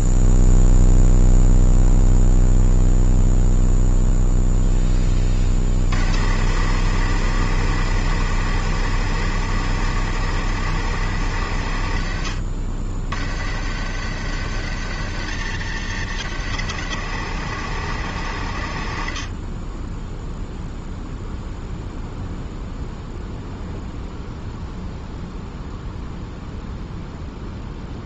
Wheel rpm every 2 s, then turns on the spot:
0, 0, 30, 140, 140, 120, 80, 130, 130, 50, 0, 0, 0, 0.
none